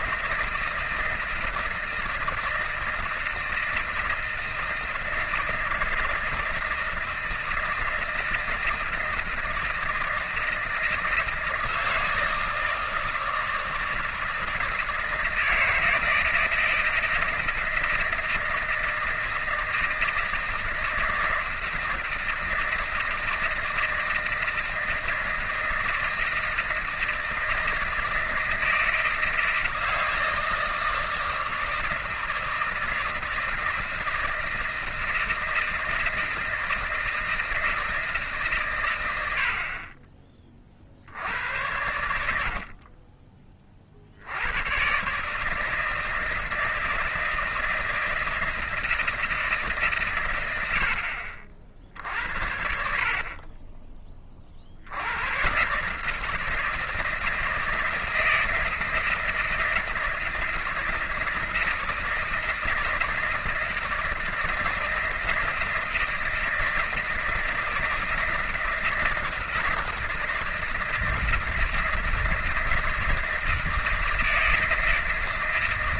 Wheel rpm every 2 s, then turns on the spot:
160, 160, 160, 160, 160, 160, 160, 160, 160, 160, 160, 160, 160, 160, 160, 160, 160, 160, 160, 140, 40, 70, 90, 160, 160, 90, 60, 40, 160, 160, 160, 160, 160, 160, 160, 160, 160, 160.
none